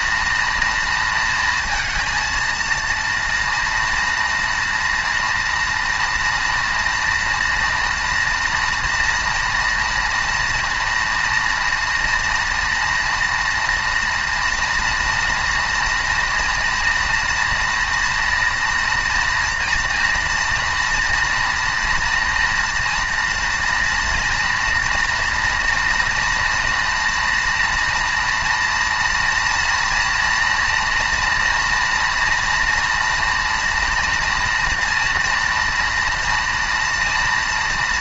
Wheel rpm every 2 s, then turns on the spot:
230, 230, 230, 230, 230, 230, 230, 230, 230, 240, 230, 230, 230, 230, 230, 230, 230, 230, 230.
none